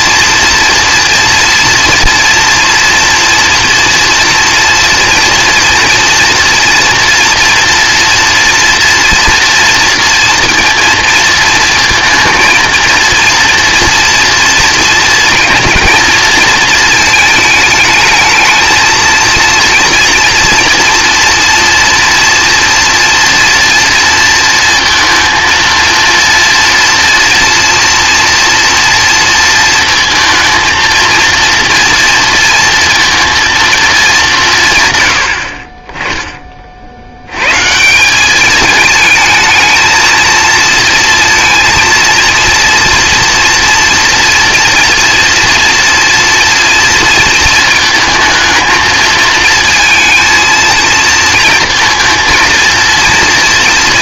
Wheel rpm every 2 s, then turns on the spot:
230, 230, 240, 230, 230, 230, 230, 230, 230, 220, 230, 230, 230, 230, 230, 230, 230, 140, 40, 210, 230, 230, 240, 230, 220, 230, 230.
none